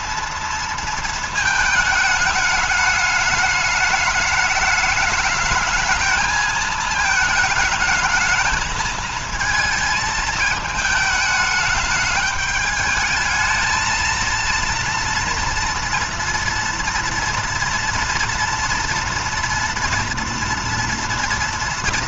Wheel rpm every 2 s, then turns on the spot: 230, 210, 210, 220, 220, 220, 210, 230, 240, 230, 230.
none